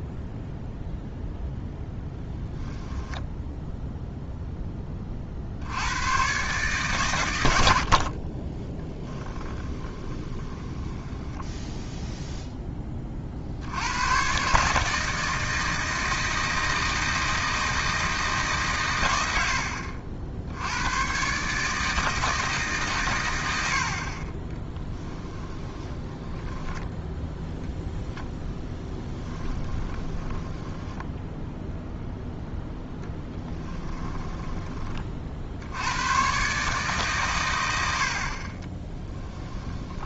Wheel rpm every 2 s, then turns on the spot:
0, 0, 20, 130, 20, 10, 20, 150, 160, 130, 90, 140, 10, 10, 20, 10, 0, 30, 140, 20.
8-12 24-32 38-40